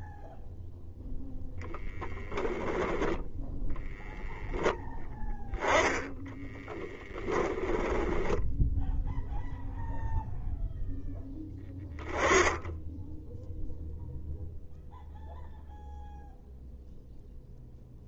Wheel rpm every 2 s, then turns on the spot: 0, 0, 0, 10, 10, 0, 10, 0, 0.
6-10